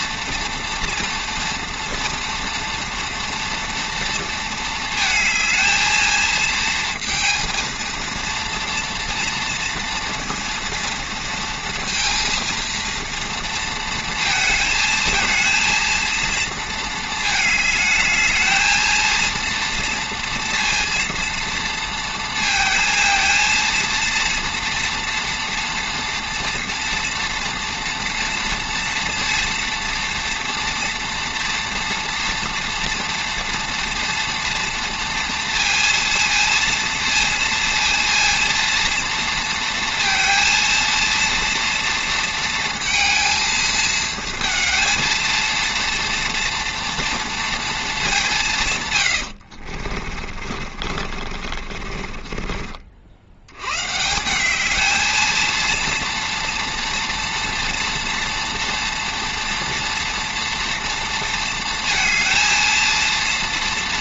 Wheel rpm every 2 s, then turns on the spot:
240, 230, 220, 230, 230, 230, 230, 220, 230, 220, 230, 230, 240, 230, 230, 230, 230, 230, 230, 230, 230, 230, 230, 240, 150, 40, 40, 200, 230, 230, 230, 230.
50-54